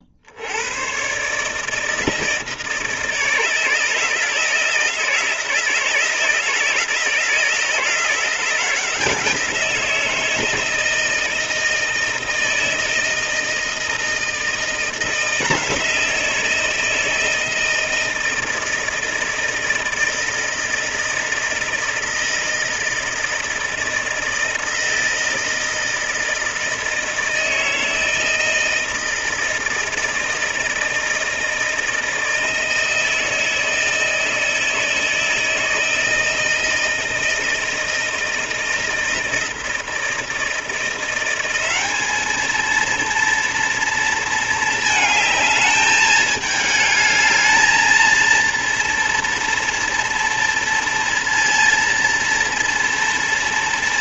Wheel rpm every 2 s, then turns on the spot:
100, 160, 160, 160, 170, 160, 160, 170, 170, 160, 160, 160, 160, 160, 160, 160, 160, 160, 160, 160, 170, 220, 220, 210, 230, 230, 230.
none